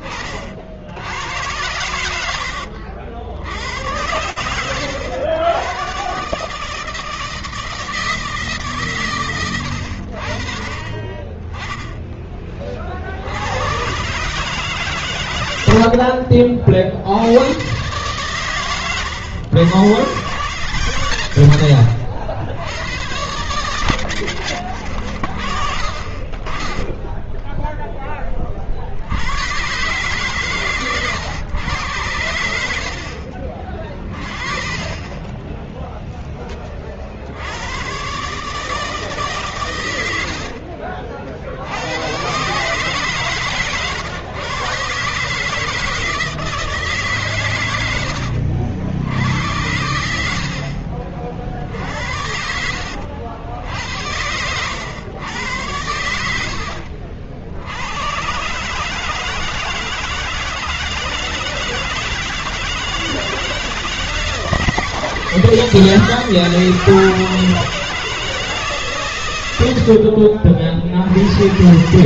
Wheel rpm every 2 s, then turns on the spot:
50, 70, 90, 160, 140, 30, 50, 140, 70, 120, 130, 100, 60, 20, 70, 120, 70, 30, 40, 160, 50, 140, 120, 150, 80, 50, 80, 100, 80, 160, 170, 170, 170, 170, 140, 70.
26-28